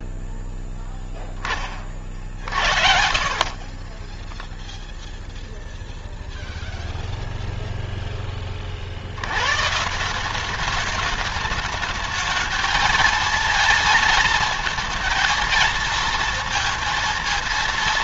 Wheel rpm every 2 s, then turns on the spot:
0, 50, 10, 0, 30, 190, 220, 230, 230.
2-6